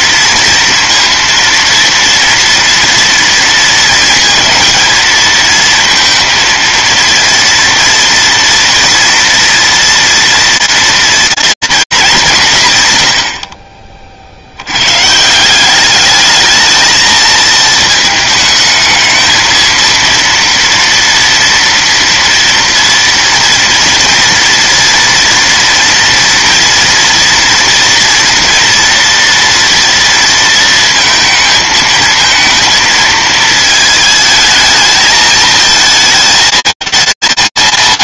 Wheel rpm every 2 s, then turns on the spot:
230, 230, 220, 230, 230, 230, 150, 80, 220, 220, 230, 230, 230, 230, 230, 230, 230, 220, 220.
none